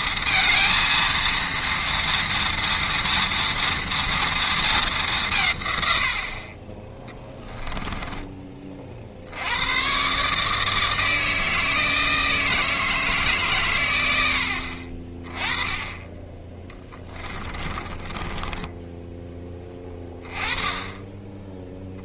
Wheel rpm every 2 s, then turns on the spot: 230, 230, 230, 50, 30, 140, 160, 80, 20, 30, 20.
18-20